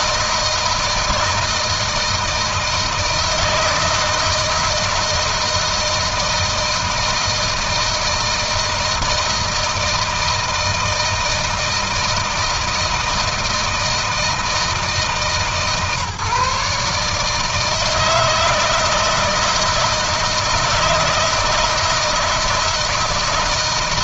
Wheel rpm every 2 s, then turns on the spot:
160, 160, 160, 160, 160, 160, 160, 160, 150, 160, 160, 160.
none